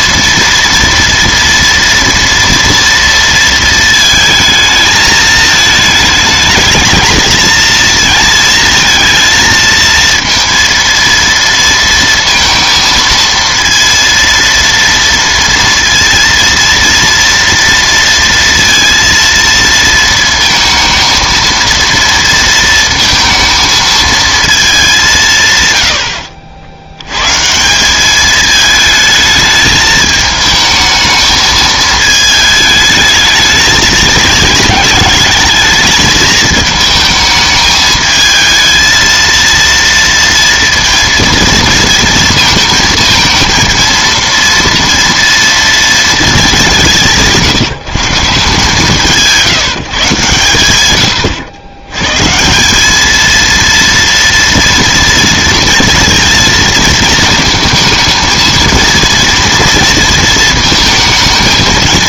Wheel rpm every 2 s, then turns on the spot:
230, 230, 220, 220, 230, 230, 230, 230, 230, 230, 230, 230, 210, 70, 220, 220, 220, 220, 220, 220, 230, 230, 230, 180, 140, 120, 180, 230, 230, 220, 220.
none